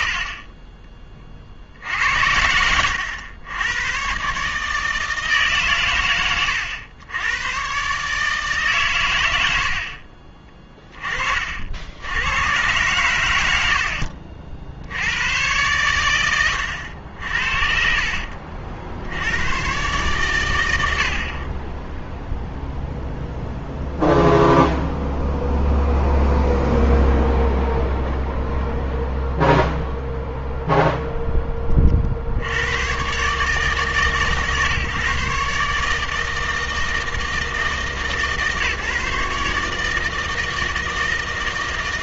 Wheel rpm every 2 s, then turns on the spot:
60, 80, 140, 100, 150, 30, 110, 60, 100, 70, 100, 0, 0, 0, 0, 0, 90, 140, 160, 150, 160.
16-18